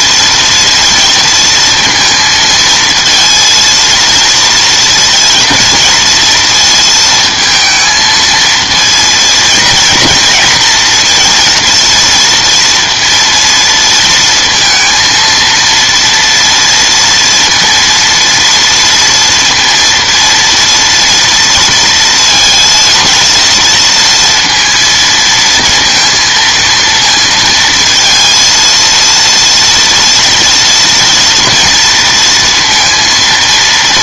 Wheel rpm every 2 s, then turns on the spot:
230, 230, 230, 230, 220, 230, 230, 230, 230, 230, 230, 230, 230, 230, 230, 230, 230.
none